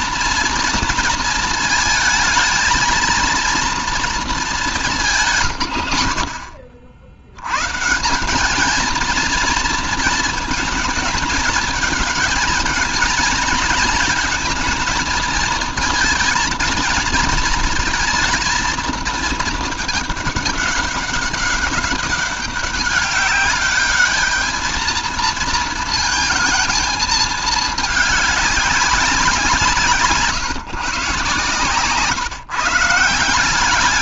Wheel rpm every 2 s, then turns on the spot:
230, 230, 200, 60, 220, 220, 220, 220, 230, 220, 200, 200, 220, 220, 200, 140, 150.
none